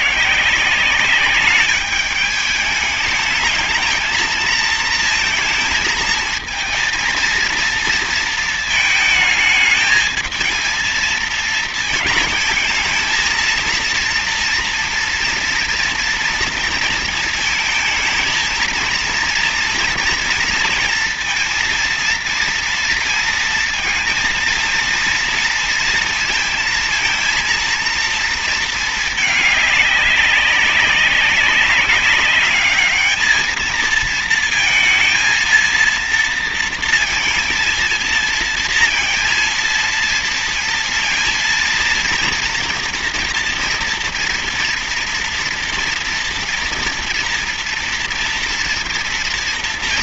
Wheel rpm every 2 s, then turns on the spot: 170, 210, 220, 220, 220, 230, 220, 240, 230, 230, 230, 230, 230, 230, 220, 190, 200, 220, 230, 230, 230, 230, 230, 230, 230.
none